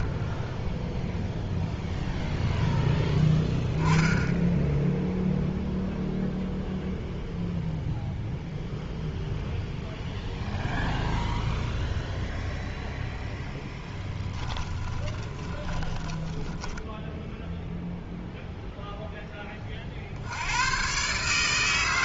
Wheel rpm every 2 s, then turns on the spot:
0, 0, 0, 0, 0, 0, 0, 20, 10, 0, 110.
14-18